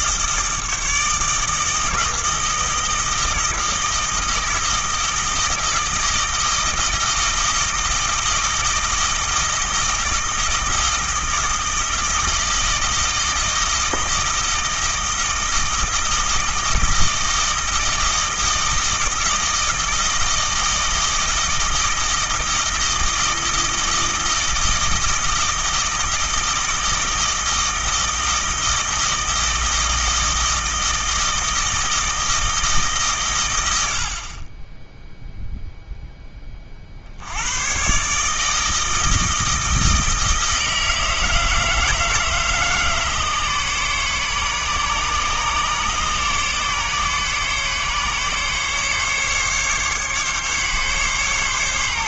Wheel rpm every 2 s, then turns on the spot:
160, 160, 160, 160, 160, 160, 160, 160, 160, 160, 160, 160, 160, 160, 160, 160, 140, 0, 60, 160, 160, 150, 140, 140, 140, 140.
none